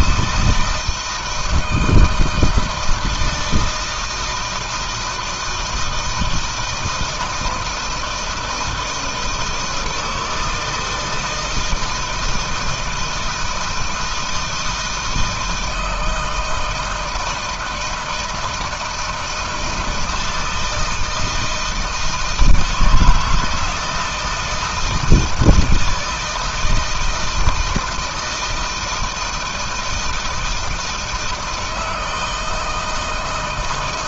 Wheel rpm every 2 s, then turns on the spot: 160, 160, 170, 160, 160, 160, 160, 160, 160, 160, 160, 160, 160, 160, 160, 160, 160.
none